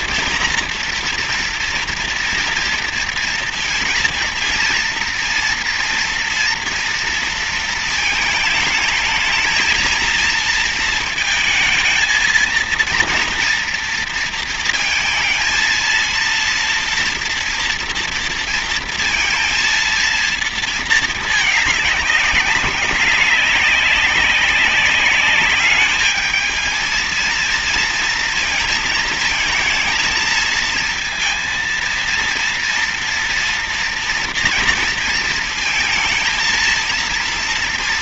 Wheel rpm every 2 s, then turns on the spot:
240, 230, 230, 230, 220, 230, 230, 230, 230, 230, 230, 210, 200, 220, 230, 220, 230, 230, 230.
none